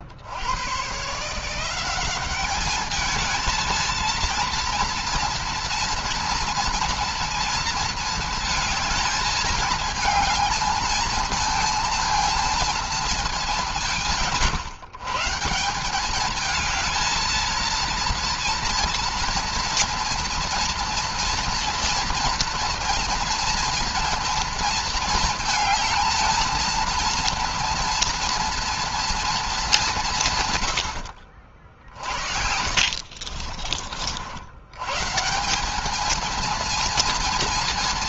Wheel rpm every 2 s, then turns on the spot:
80, 200, 230, 230, 220, 220, 230, 150, 210, 230, 230, 230, 230, 230, 230, 130, 60, 90, 230.
32-34